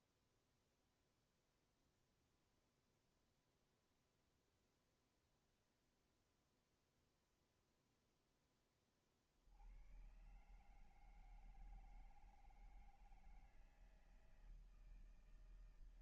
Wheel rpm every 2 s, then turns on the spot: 0, 0, 0, 0, 10, 120, 160, 160.
none